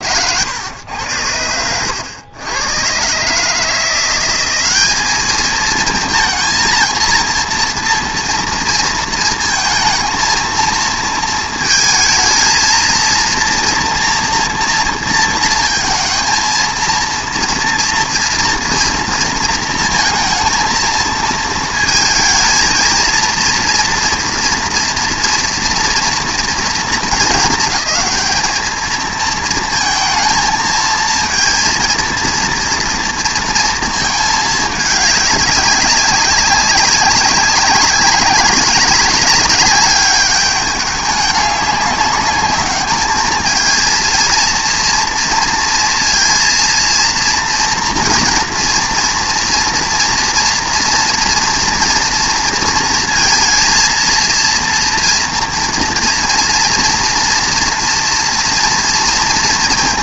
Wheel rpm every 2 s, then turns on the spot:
100, 110, 200, 230, 230, 230, 230, 230, 230, 230, 230, 220, 230, 220, 220, 220, 230, 210, 190, 200, 210, 210, 230, 230, 230, 230, 230, 230, 230, 240.
none